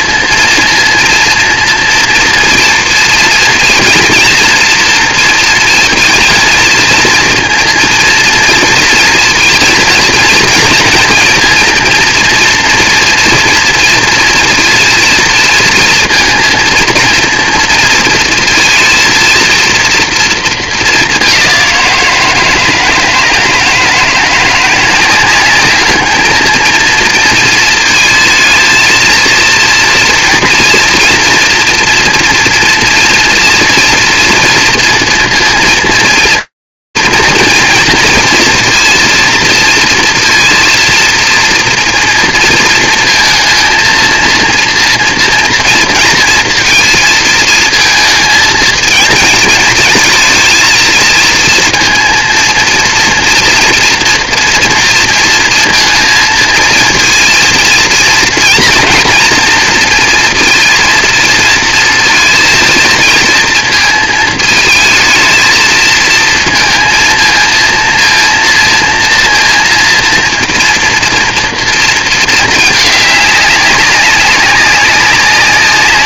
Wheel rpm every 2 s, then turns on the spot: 230, 230, 230, 230, 230, 230, 240, 230, 230, 230, 220, 160, 170, 230, 220, 240, 230, 230, 230, 230, 230, 230, 230, 230, 220, 230, 230, 230, 230, 230, 230, 220, 220, 220, 230, 230, 210, 190.
none